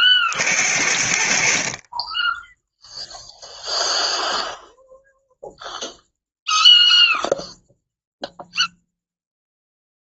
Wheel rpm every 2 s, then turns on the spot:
60, 0, 0, 0, 0.
none